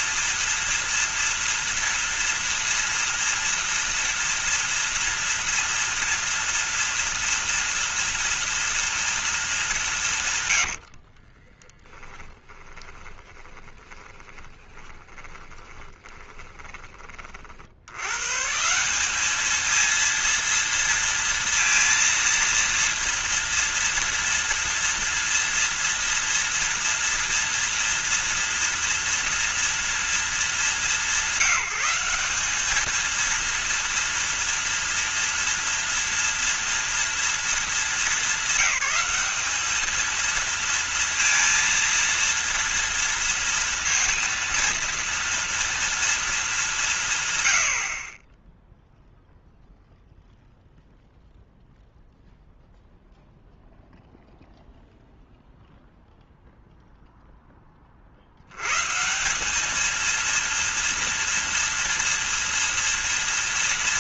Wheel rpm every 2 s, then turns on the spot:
230, 230, 230, 230, 230, 100, 10, 20, 20, 150, 230, 230, 230, 230, 230, 210, 210, 230, 230, 190, 230, 230, 230, 200, 10, 0, 0, 0, 0, 100, 230, 230.
10-18